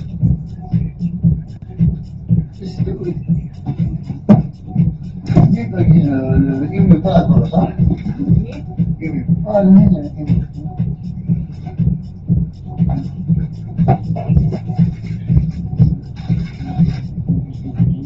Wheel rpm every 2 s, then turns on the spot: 0, 0, 0, 0, 0, 0, 0, 0, 0.
none